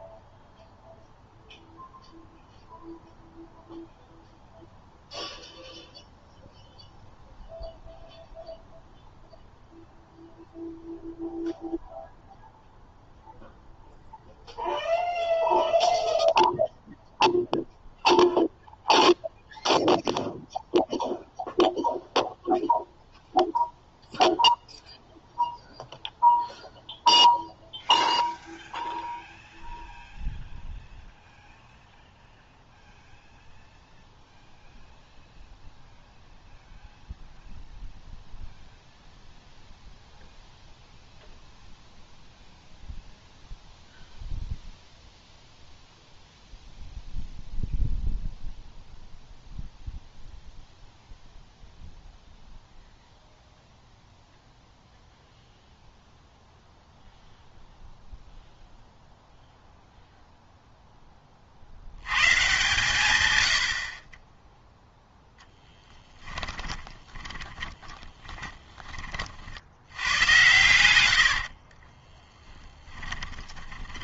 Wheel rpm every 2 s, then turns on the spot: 0, 0, 0, 0, 0, 0, 0, 0, 0, 0, 0, 0, 0, 0, 0, 0, 0, 0, 0, 0, 0, 0, 0, 0, 0, 0, 0, 0, 0, 0, 0, 150, 0, 20, 20, 100, 10.
66-70 72-74